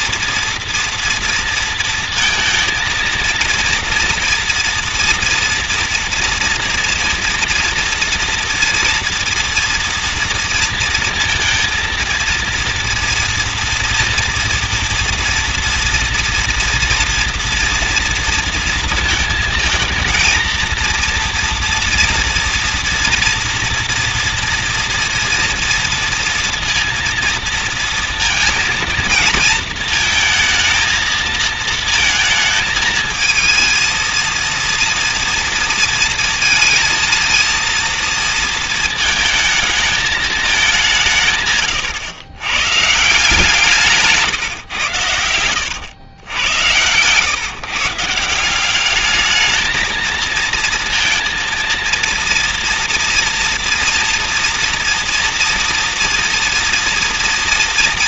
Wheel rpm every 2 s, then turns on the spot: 240, 230, 230, 230, 230, 230, 230, 230, 230, 230, 230, 240, 230, 230, 230, 230, 220, 230, 220, 230, 200, 120, 130, 100, 180, 220, 230, 230, 230.
none